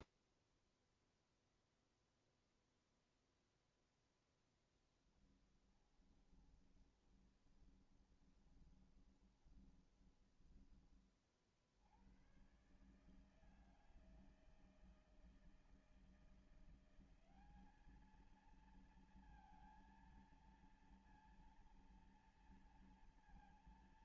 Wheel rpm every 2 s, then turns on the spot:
0, 0, 10, 30, 20, 20, 120, 160, 170, 220, 230, 240.
4-12